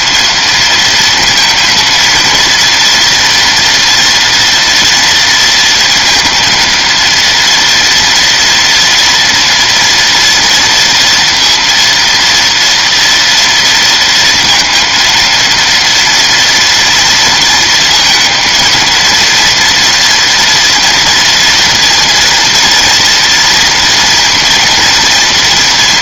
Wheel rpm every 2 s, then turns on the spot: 220, 230, 230, 230, 230, 230, 230, 230, 230, 230, 240, 230, 230.
none